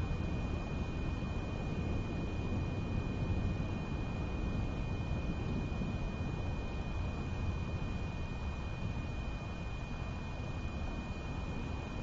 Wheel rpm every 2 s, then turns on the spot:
0, 0, 0, 0, 0, 0.
none